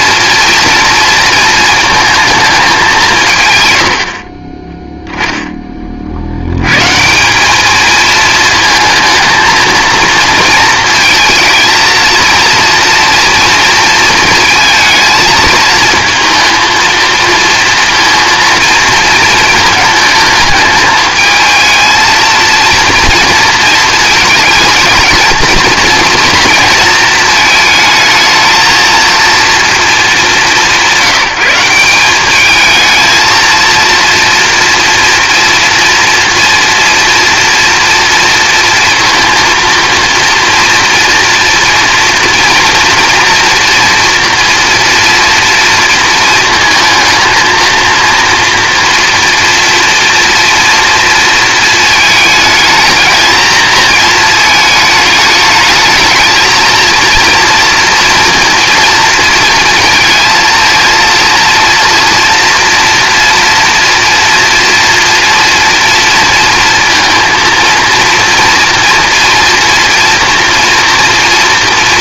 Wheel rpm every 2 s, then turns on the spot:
230, 210, 30, 120, 220, 220, 230, 230, 230, 230, 220, 230, 220, 230, 220, 190, 220, 230, 230, 230, 240, 240, 240, 230, 230, 230, 220, 220, 230, 230, 230, 240, 230, 230, 230, 230.
none